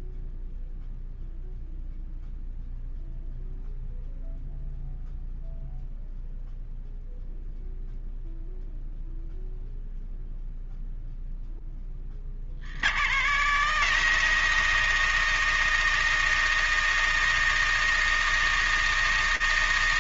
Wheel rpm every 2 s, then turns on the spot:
0, 0, 0, 0, 0, 0, 110, 160, 160, 160.
none